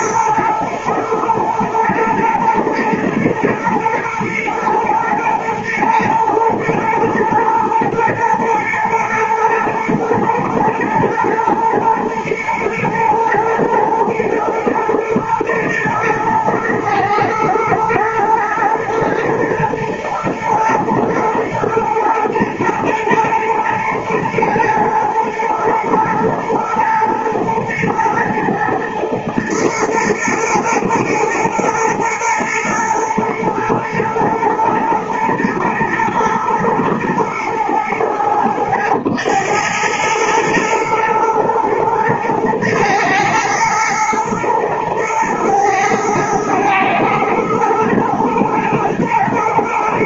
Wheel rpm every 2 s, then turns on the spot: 120, 110, 110, 110, 110, 110, 120, 110, 110, 120, 110, 110, 120, 120, 110, 120, 110, 120, 100, 40, 110, 110, 110, 120, 110.
none